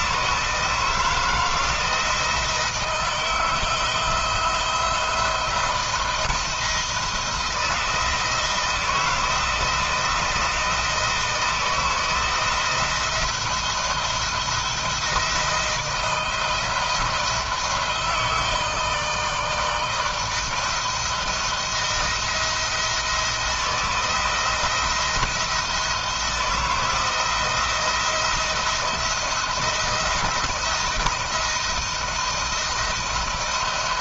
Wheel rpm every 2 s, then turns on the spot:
170, 170, 170, 170, 170, 170, 170, 170, 160, 160, 160, 170, 170, 170, 170, 170, 160.
none